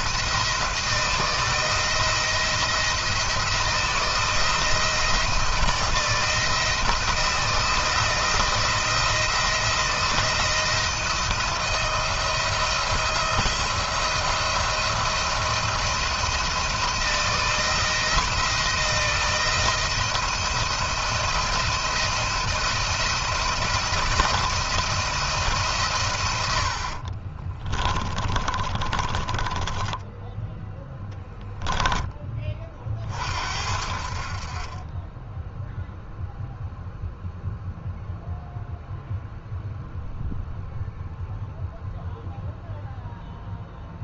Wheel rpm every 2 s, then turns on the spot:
160, 160, 160, 160, 160, 170, 170, 170, 170, 160, 170, 170, 170, 90, 30, 10, 30, 40, 0, 0, 0, 0.
28-32